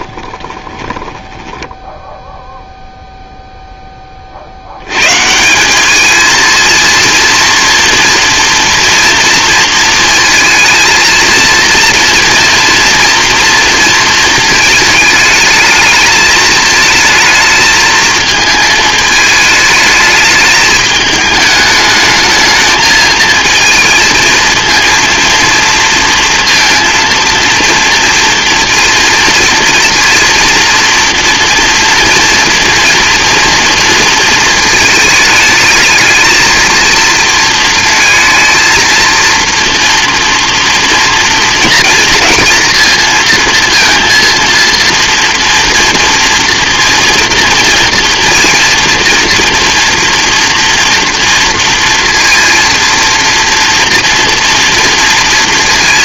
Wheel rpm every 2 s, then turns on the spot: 10, 0, 70, 230, 230, 230, 230, 220, 220, 220, 210, 220, 230, 230, 230, 230, 230, 220, 230, 230, 230, 230, 230, 230, 230, 230, 240, 240.
0-2